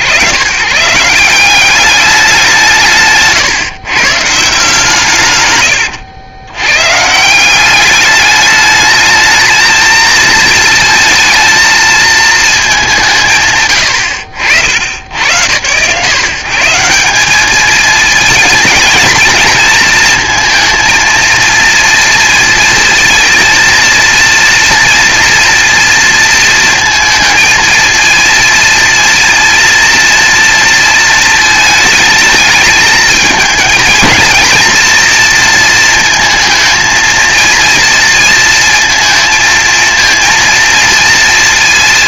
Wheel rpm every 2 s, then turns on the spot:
140, 170, 150, 130, 210, 230, 210, 100, 170, 220, 230, 230, 230, 230, 230, 230, 220, 230, 230, 230, 230.
none